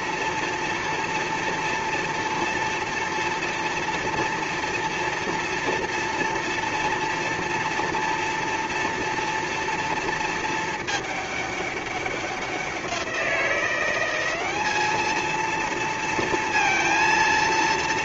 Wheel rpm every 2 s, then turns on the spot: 230, 230, 230, 230, 230, 220, 190, 190, 230.
none